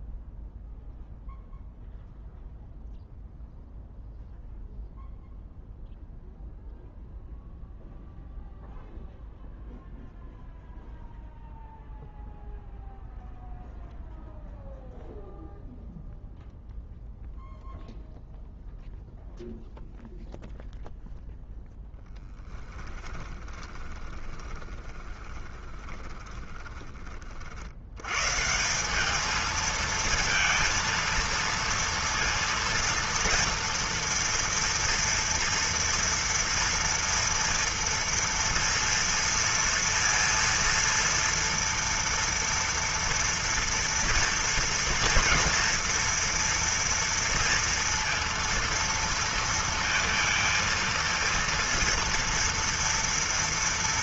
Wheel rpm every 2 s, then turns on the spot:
0, 0, 0, 0, 0, 0, 0, 0, 0, 0, 0, 10, 20, 30, 200, 230, 230, 230, 230, 230, 230, 230, 230, 230, 230, 230, 230.
22-26